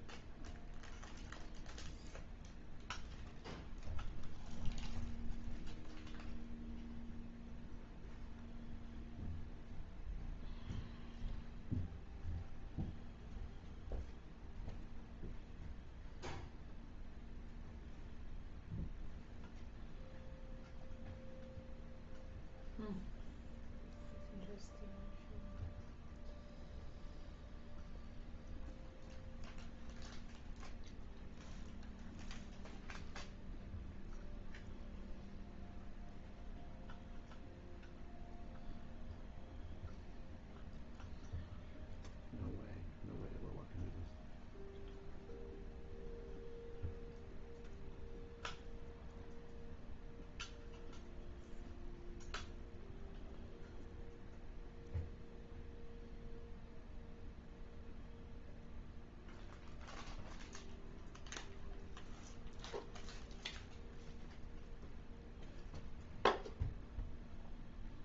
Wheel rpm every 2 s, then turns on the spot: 0, 0, 0, 0, 0, 0, 0, 0, 0, 0, 0, 0, 0, 0, 0, 0, 0, 0, 0, 0, 0, 0, 0, 0, 0, 0, 0, 0, 0, 0, 0, 0, 0, 0.
none